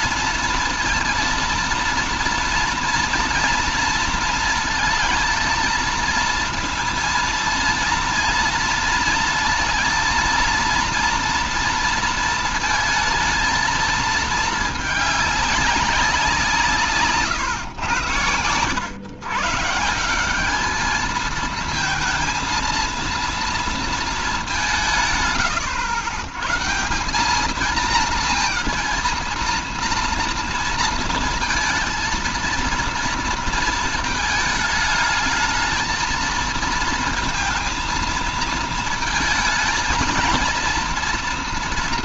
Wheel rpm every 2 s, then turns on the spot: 230, 230, 230, 230, 230, 230, 220, 220, 170, 90, 200, 230, 200, 140, 230, 230, 230, 220, 230, 230, 230.
none